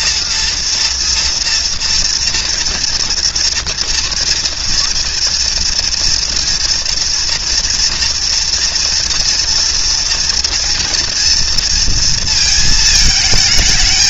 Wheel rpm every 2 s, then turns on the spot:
230, 230, 240, 240, 230, 230, 220.
none